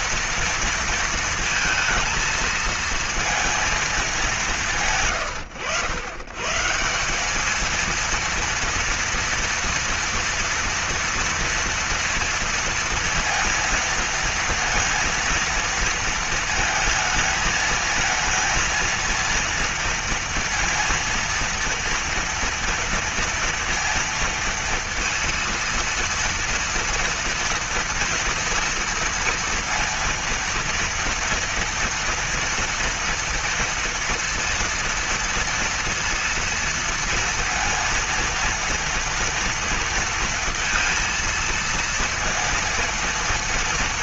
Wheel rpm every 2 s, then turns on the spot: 230, 230, 160, 160, 230, 230, 230, 230, 220, 230, 230, 230, 230, 230, 230, 230, 230, 230, 230, 230, 230, 230.
none